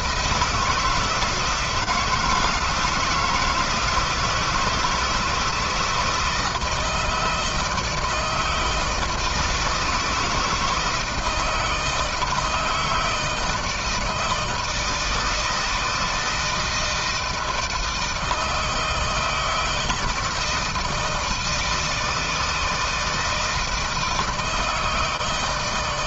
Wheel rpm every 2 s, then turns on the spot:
160, 170, 160, 160, 160, 160, 160, 160, 160, 160, 160, 160, 160.
none